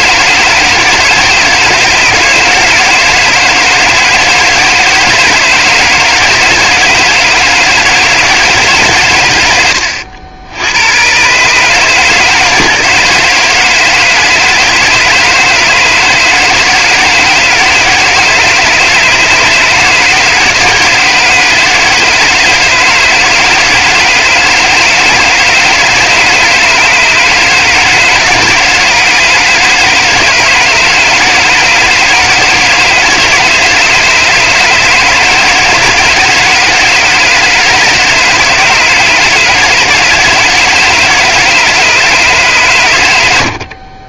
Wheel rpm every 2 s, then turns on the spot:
160, 160, 160, 160, 140, 90, 160, 160, 160, 160, 160, 160, 160, 160, 160, 160, 160, 160, 160, 160, 160, 130.
none